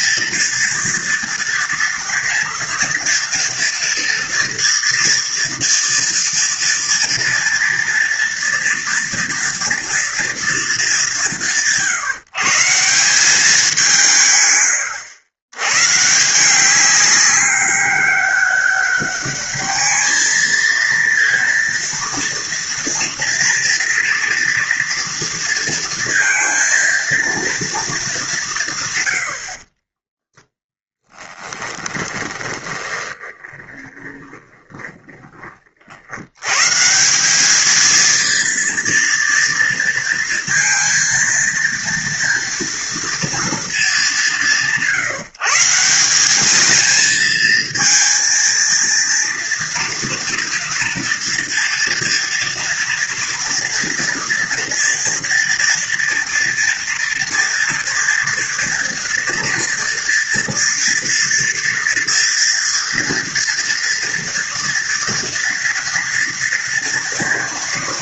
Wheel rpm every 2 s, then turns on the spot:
230, 230, 230, 230, 230, 180, 180, 100, 190, 200, 230, 230, 230, 230, 120, 10, 20, 20, 150, 230, 230, 230, 170, 220, 230, 240, 230, 230, 230, 240, 230, 230, 230, 230.
32-36